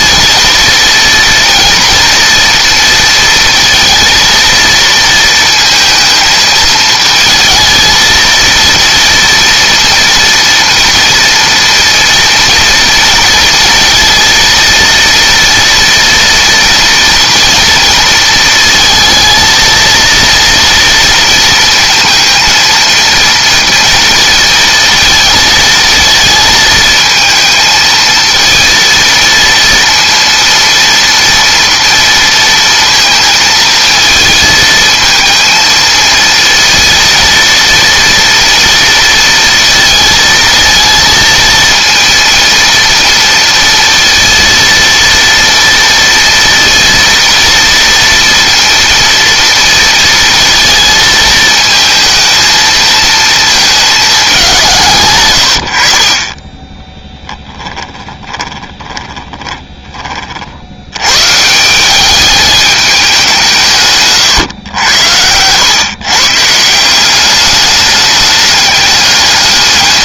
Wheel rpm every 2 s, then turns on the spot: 240, 230, 230, 220, 230, 230, 230, 230, 230, 220, 230, 230, 230, 220, 230, 230, 230, 220, 230, 230, 230, 230, 230, 230, 230, 220, 220, 120, 10, 20, 110, 200, 100, 190, 210.
56-60